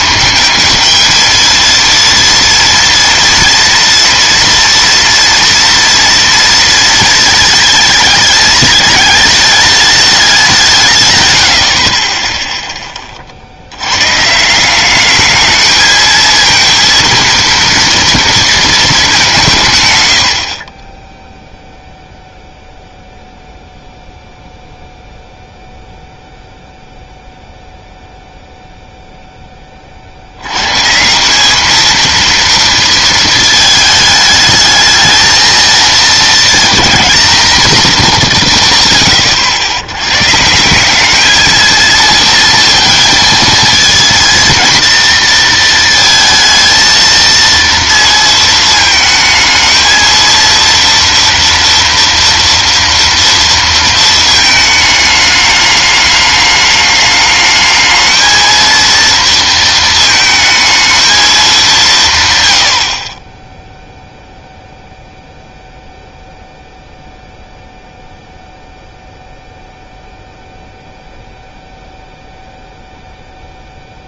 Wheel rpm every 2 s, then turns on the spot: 220, 230, 230, 230, 210, 180, 10, 170, 230, 220, 40, 0, 0, 0, 0, 130, 230, 210, 230, 160, 170, 230, 230, 230, 220, 230, 240, 220, 210, 230, 220, 90, 0, 0, 0, 0, 0.
none